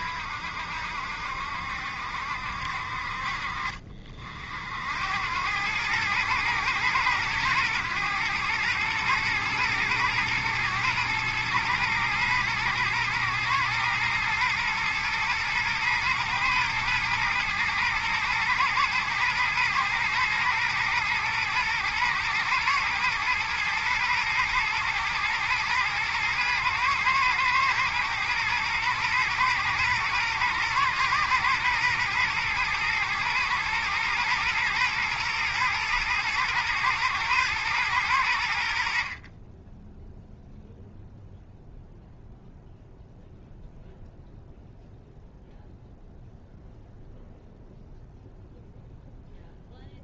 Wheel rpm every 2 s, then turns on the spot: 70, 60, 90, 110, 110, 110, 110, 110, 110, 110, 110, 120, 110, 110, 110, 120, 110, 120, 120, 50, 0, 0, 0, 0, 0.
none